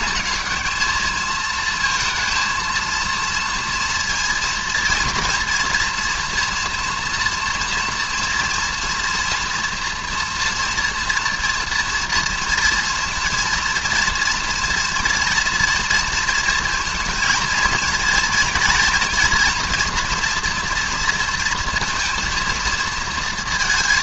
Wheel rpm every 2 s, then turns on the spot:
220, 230, 230, 240, 230, 230, 230, 230, 220, 230, 230, 230.
none